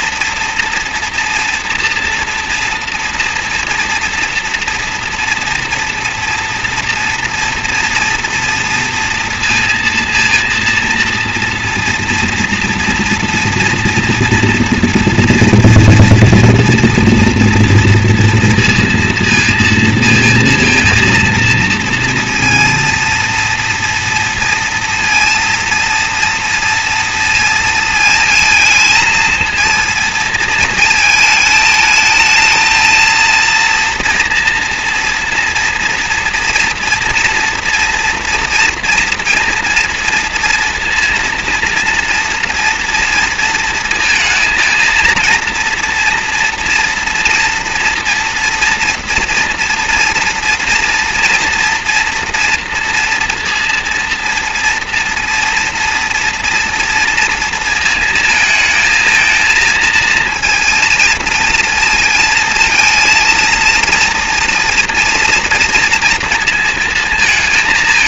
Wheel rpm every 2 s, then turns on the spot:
230, 230, 230, 230, 230, 230, 230, 240, 230, 230, 230, 230, 230, 230, 230, 220, 230, 230, 230, 230, 230, 230, 230, 230, 240, 230, 230, 230, 230, 220, 230, 230, 230, 230.
none